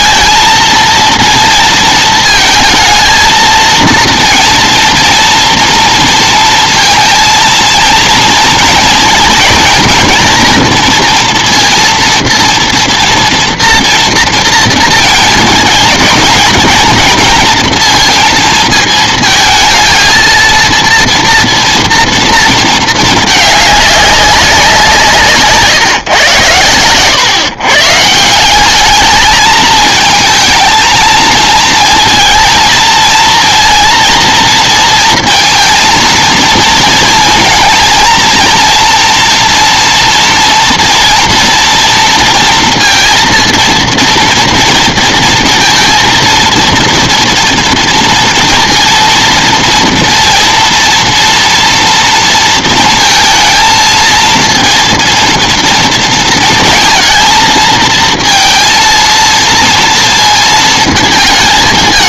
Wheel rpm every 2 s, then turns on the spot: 230, 220, 230, 220, 230, 230, 230, 230, 220, 220, 230, 220, 170, 110, 200, 220, 230, 230, 230, 230, 230, 230, 230, 230, 230, 240, 230, 230, 220, 230, 230.
none